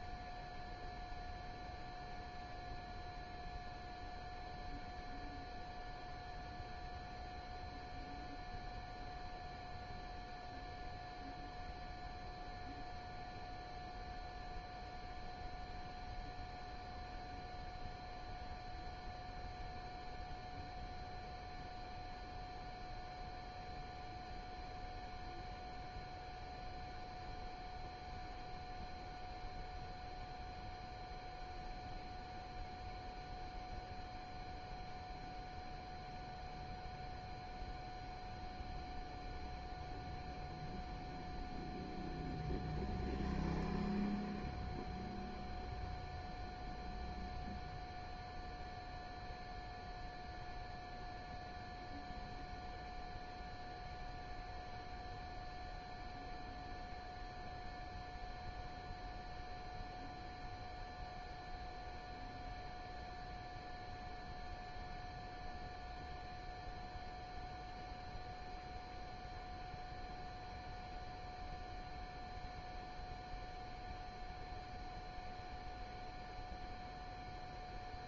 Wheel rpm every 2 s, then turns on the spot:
0, 0, 0, 0, 0, 0, 0, 0, 0, 0, 0, 0, 0, 0, 0, 0, 0, 0, 0, 0, 0, 0, 0, 0, 0, 0, 0, 0, 0, 0, 0, 0, 0, 0, 0, 0, 0, 0, 0.
none